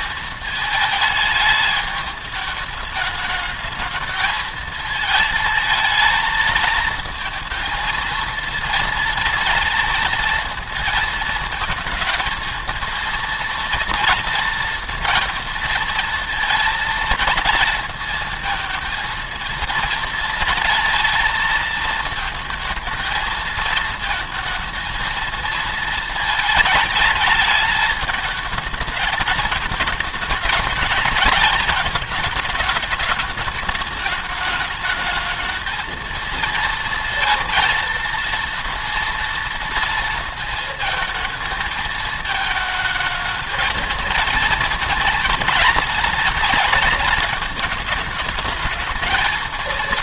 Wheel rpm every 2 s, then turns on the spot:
220, 210, 220, 220, 230, 230, 220, 230, 230, 230, 230, 230, 230, 220, 220, 210, 220, 210, 230, 230, 230, 220, 220, 230, 220.
none